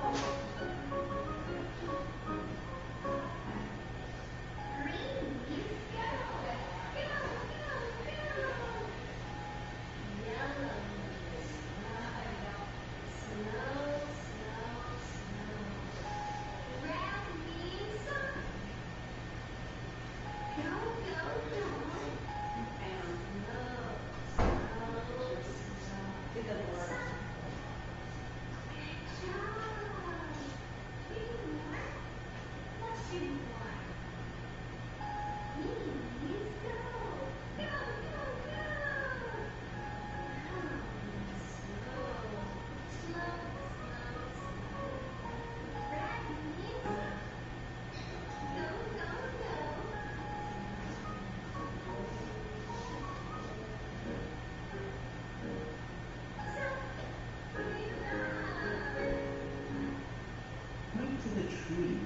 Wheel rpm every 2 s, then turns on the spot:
0, 0, 0, 0, 0, 0, 0, 0, 0, 0, 0, 0, 0, 0, 0, 0, 0, 0, 0, 0, 0, 0, 0, 0, 0, 0, 0, 0, 0, 0, 0.
none